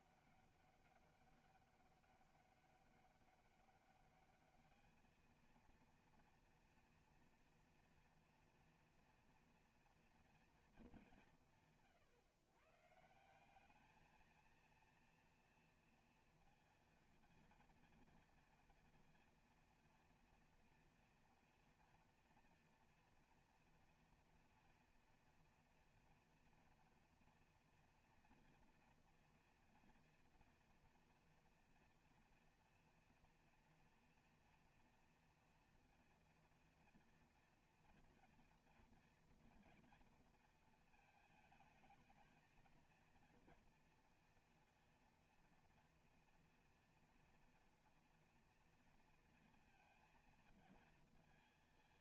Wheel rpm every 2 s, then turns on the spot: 200, 200, 210, 240, 240, 230, 130, 230, 230, 230, 230, 240, 240, 230, 230, 240, 230, 230, 230, 230, 230, 230, 230, 230, 230, 230.
none